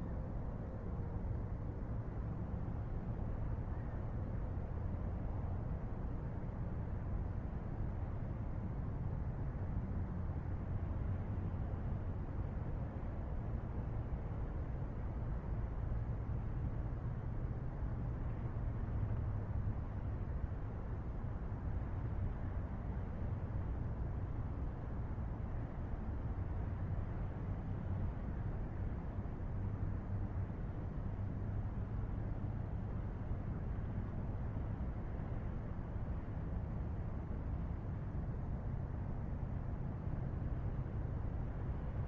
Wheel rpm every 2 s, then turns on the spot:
0, 0, 0, 0, 0, 0, 0, 0, 0, 0, 0, 0, 0, 0, 0, 0, 0, 0, 0, 0, 0.
none